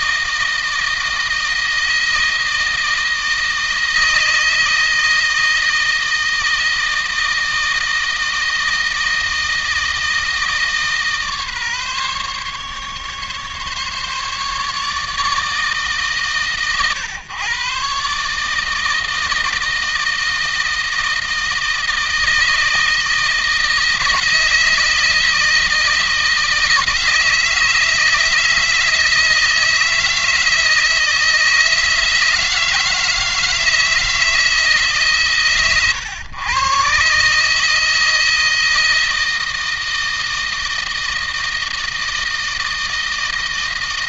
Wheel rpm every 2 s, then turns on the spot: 160, 160, 160, 160, 160, 150, 140, 150, 130, 160, 160, 160, 160, 160, 160, 160, 160, 150, 130, 160, 160, 160.
none